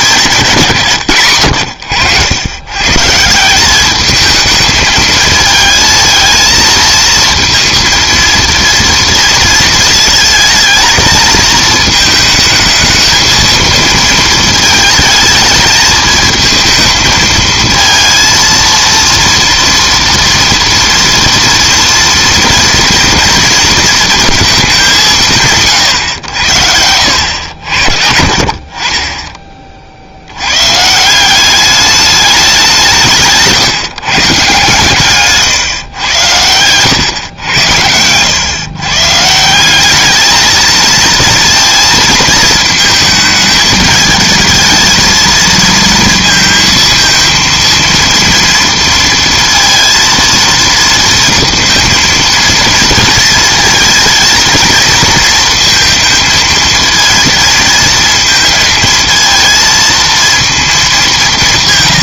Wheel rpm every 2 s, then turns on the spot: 170, 120, 220, 220, 230, 220, 220, 220, 220, 230, 230, 230, 210, 80, 40, 120, 190, 140, 100, 120, 220, 230, 220, 220, 230, 230, 230, 220, 220, 220, 220.
36-38